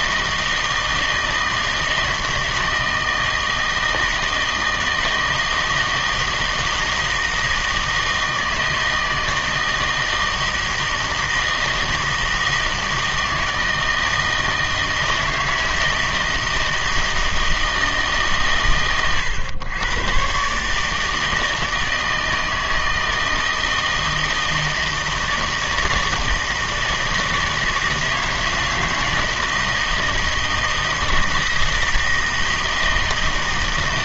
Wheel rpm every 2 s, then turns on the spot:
160, 160, 160, 160, 160, 160, 160, 160, 160, 130, 140, 160, 160, 160, 160, 160, 160.
none